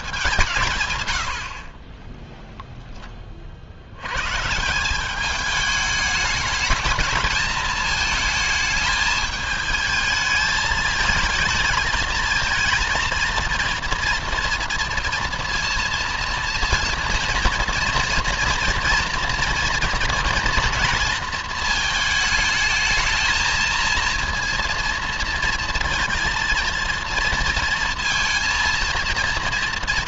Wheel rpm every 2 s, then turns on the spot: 120, 10, 180, 220, 220, 220, 220, 230, 230, 230, 230, 220, 230, 230, 230.
none